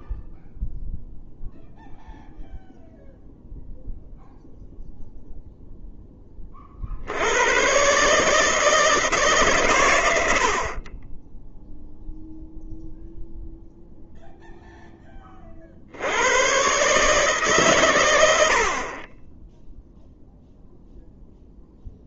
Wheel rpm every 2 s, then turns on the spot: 0, 0, 0, 40, 160, 50, 0, 0, 130, 60, 0.
none